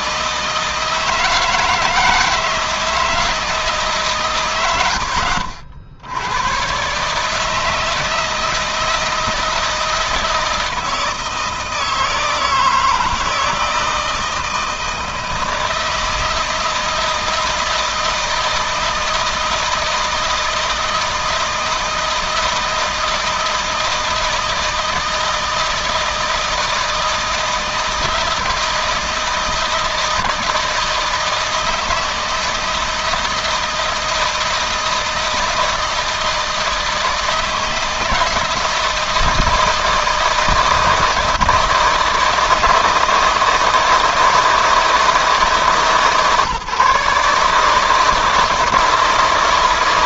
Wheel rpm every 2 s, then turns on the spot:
160, 160, 90, 140, 160, 160, 160, 160, 160, 160, 160, 160, 160, 160, 160, 160, 160, 170, 160, 160, 160, 160, 160, 140, 160.
none